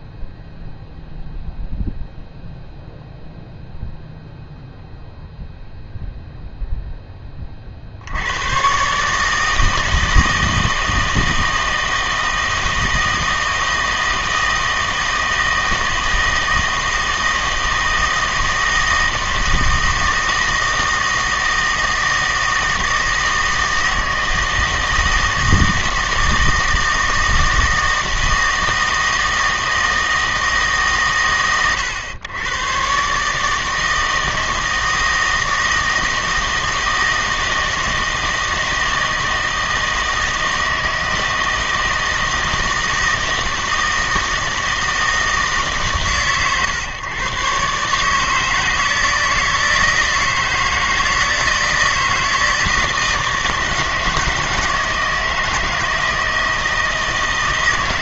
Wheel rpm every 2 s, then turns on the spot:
0, 0, 0, 0, 110, 160, 160, 160, 160, 160, 160, 160, 160, 160, 160, 150, 120, 160, 160, 160, 160, 160, 160, 130, 160, 160, 160, 160, 160.
none